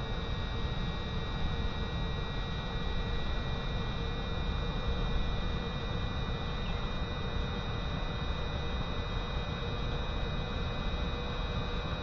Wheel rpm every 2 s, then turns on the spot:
0, 0, 0, 0, 0, 0.
none